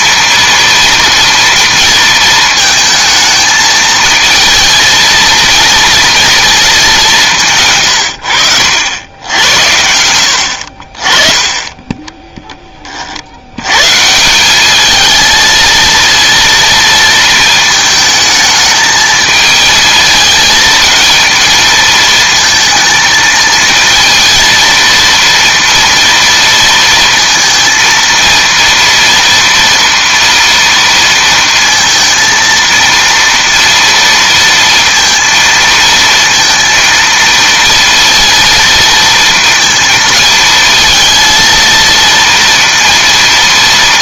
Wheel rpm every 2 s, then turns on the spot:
230, 220, 220, 220, 90, 60, 20, 200, 230, 220, 220, 220, 230, 230, 230, 230, 230, 230, 230, 230, 220, 230.
none